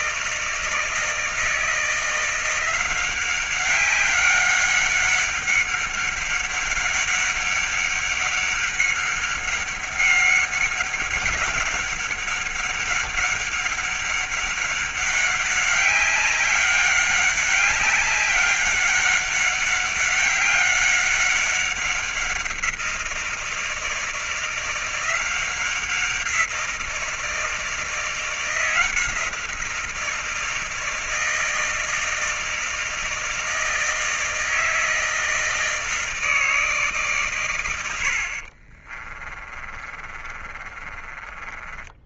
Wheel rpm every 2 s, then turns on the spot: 160, 180, 200, 200, 190, 190, 190, 190, 200, 200, 200, 170, 170, 170, 170, 160, 160, 160, 150, 40, 30.
38-42